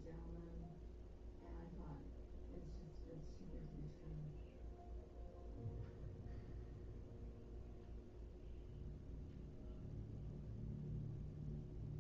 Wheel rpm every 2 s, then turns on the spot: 0, 0, 0, 0, 0, 0.
none